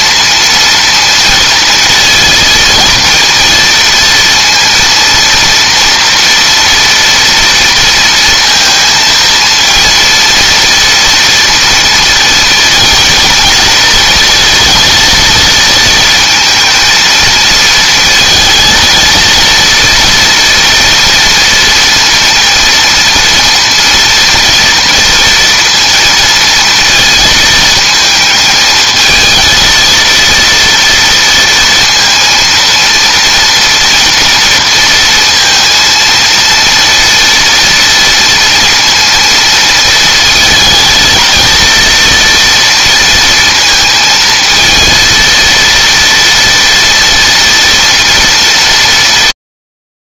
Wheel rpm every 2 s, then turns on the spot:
230, 230, 230, 230, 230, 240, 230, 230, 230, 230, 240, 230, 230, 220, 220, 230, 230, 230, 230, 230, 220, 230, 220, 230, 220.
none